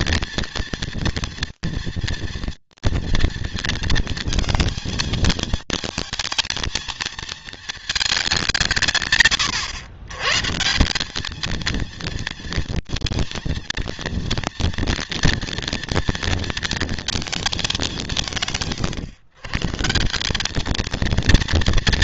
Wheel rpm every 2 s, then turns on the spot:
230, 230, 220, 230, 170, 150, 230, 230, 230, 140, 200.
none